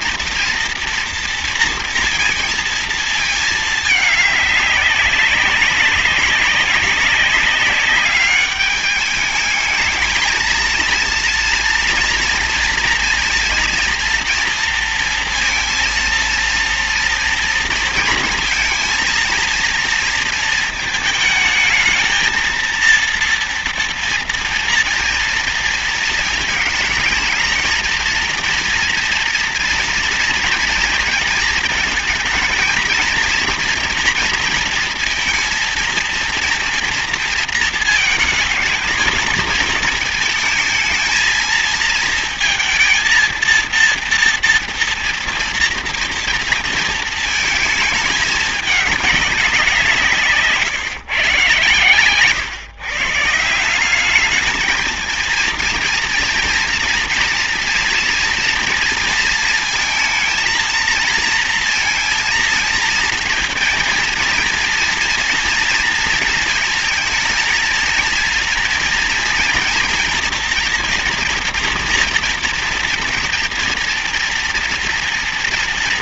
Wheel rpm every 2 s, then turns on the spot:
230, 230, 200, 200, 210, 230, 230, 230, 230, 230, 220, 230, 230, 220, 230, 230, 230, 230, 230, 220, 230, 230, 230, 230, 210, 150, 140, 230, 230, 230, 230, 230, 230, 220, 230, 230, 240, 230.
none